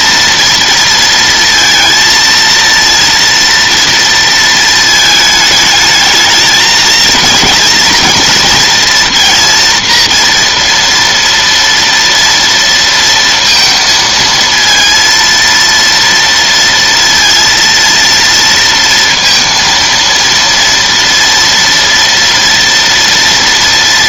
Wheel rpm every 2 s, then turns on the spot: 230, 230, 220, 220, 230, 230, 230, 230, 230, 230, 230, 230.
none